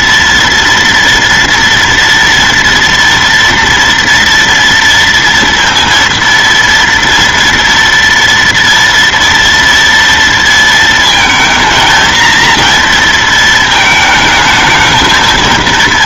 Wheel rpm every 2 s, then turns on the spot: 240, 230, 230, 230, 230, 230, 230, 220.
none